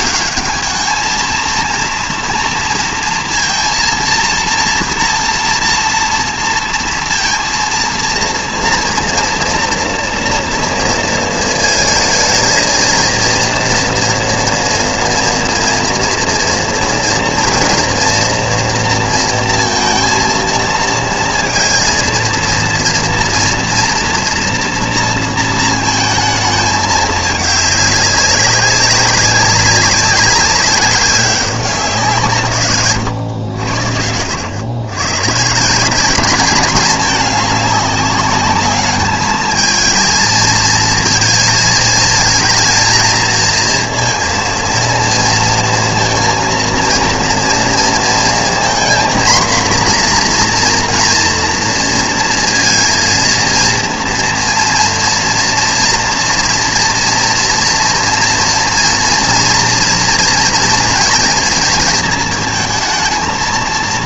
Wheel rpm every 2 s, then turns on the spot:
210, 230, 230, 230, 230, 230, 220, 240, 230, 230, 230, 230, 240, 220, 200, 190, 140, 90, 200, 210, 230, 220, 230, 230, 230, 240, 230, 230, 230, 230, 230, 220.
none